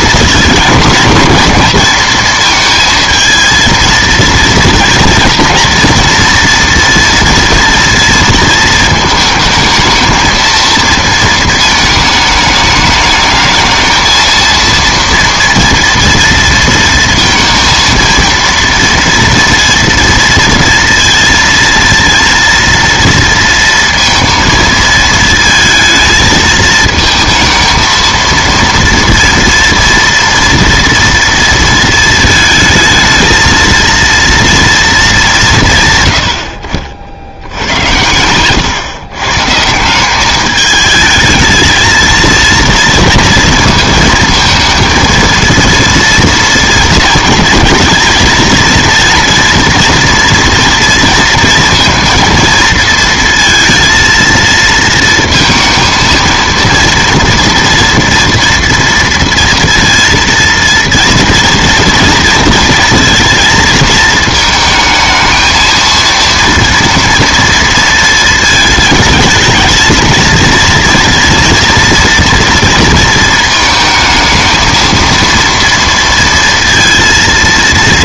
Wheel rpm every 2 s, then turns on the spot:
220, 220, 230, 230, 230, 230, 210, 230, 230, 230, 230, 230, 230, 220, 230, 230, 220, 230, 60, 130, 210, 230, 220, 230, 230, 240, 230, 230, 230, 230, 230, 230, 220, 230, 220, 230, 230, 230, 230.
none